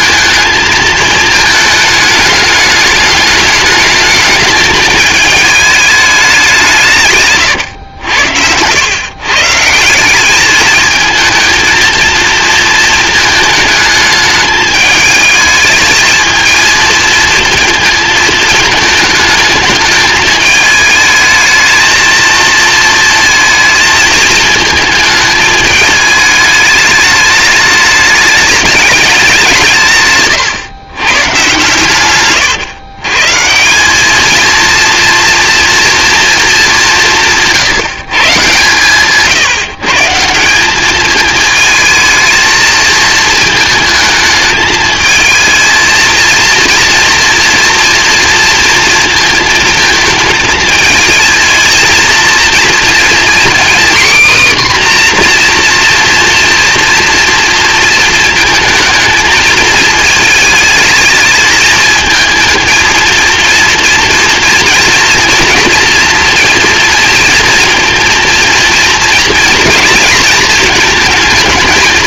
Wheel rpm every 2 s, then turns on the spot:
220, 210, 220, 180, 100, 210, 220, 210, 220, 220, 210, 230, 220, 210, 210, 120, 130, 230, 220, 140, 200, 230, 220, 230, 230, 220, 230, 260, 230, 220, 220, 220, 230, 230, 230, 220.
none